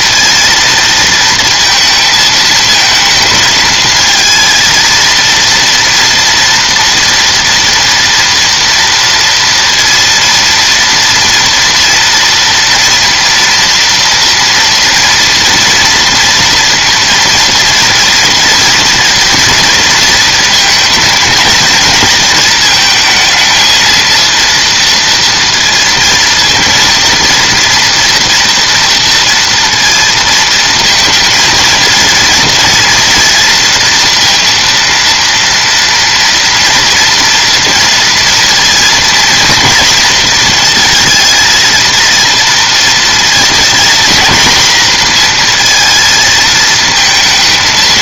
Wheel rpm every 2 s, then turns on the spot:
230, 220, 230, 230, 230, 230, 230, 230, 230, 230, 220, 220, 230, 230, 230, 230, 230, 230, 230, 240, 230, 230, 230, 220.
none